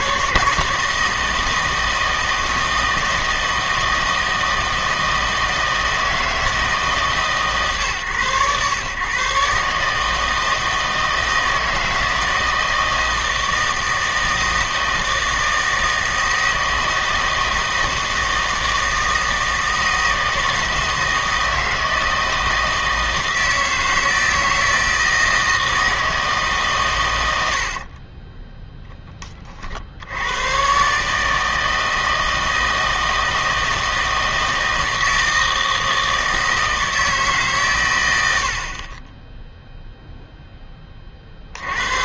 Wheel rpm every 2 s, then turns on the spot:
160, 160, 160, 160, 120, 160, 160, 160, 160, 160, 160, 160, 160, 140, 10, 120, 160, 160, 160, 50, 10.
none